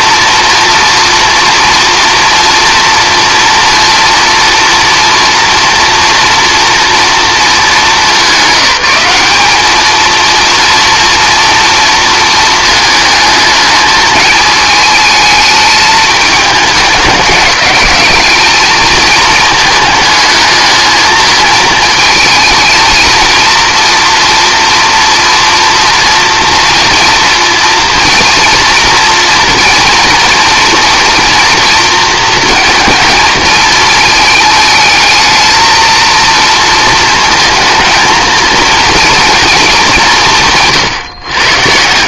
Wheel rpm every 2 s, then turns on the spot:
230, 230, 230, 230, 210, 230, 220, 220, 200, 220, 220, 220, 240, 230, 230, 230, 230, 220, 230, 230, 160.
none